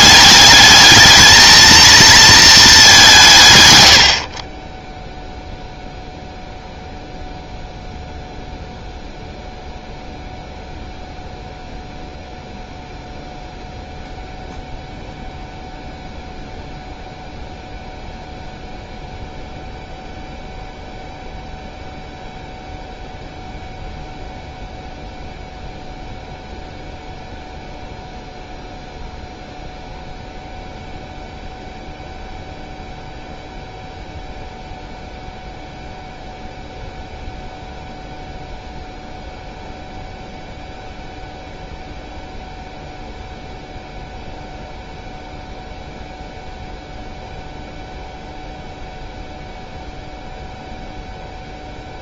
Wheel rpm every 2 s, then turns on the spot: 210, 220, 40, 0, 0, 0, 0, 0, 0, 0, 0, 0, 0, 0, 0, 0, 0, 0, 0, 0, 0, 0, 0, 0, 0, 0.
4-6